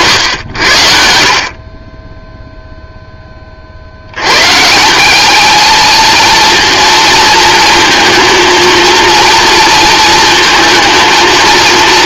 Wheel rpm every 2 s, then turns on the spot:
90, 0, 160, 230, 230, 220.
none